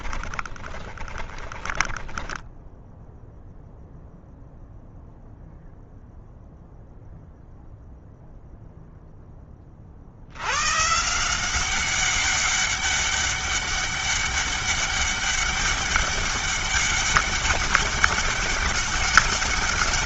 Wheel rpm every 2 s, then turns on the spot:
20, 0, 0, 0, 0, 160, 200, 200, 200, 200.
0-2